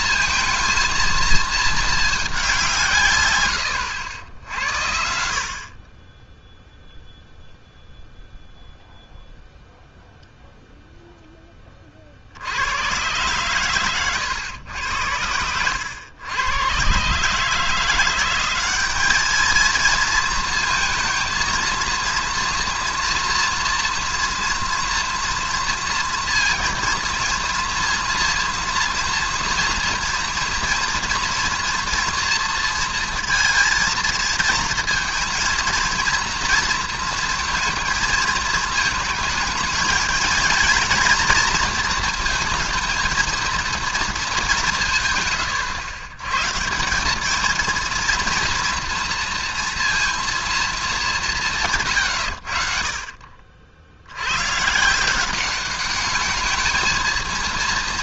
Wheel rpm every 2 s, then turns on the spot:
230, 180, 80, 0, 0, 0, 100, 100, 110, 200, 230, 230, 230, 230, 230, 230, 230, 230, 230, 220, 230, 220, 180, 170, 230, 220, 60, 140, 220.
none